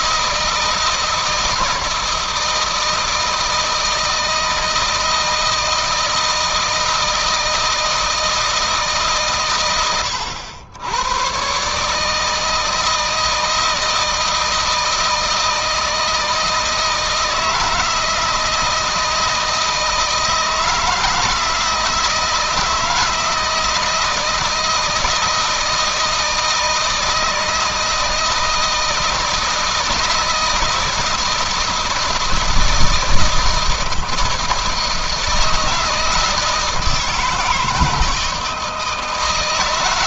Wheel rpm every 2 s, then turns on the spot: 160, 160, 160, 160, 150, 110, 160, 160, 160, 160, 170, 160, 170, 160, 160, 160, 160, 160, 160, 160.
none